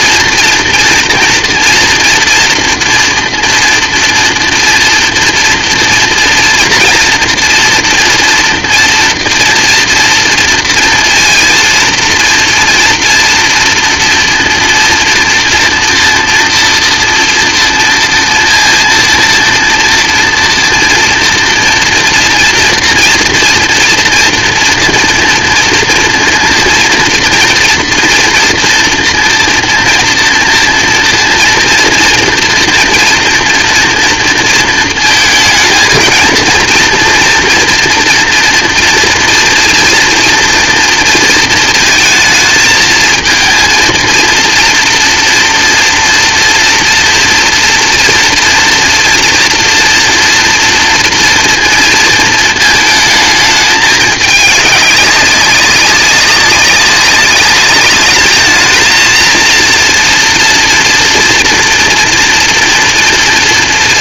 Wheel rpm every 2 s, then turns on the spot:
230, 230, 230, 230, 230, 230, 230, 230, 240, 230, 230, 230, 230, 230, 230, 230, 230, 220, 230, 230, 230, 220, 230, 240, 240, 240, 220, 200, 200, 230, 240, 230.
none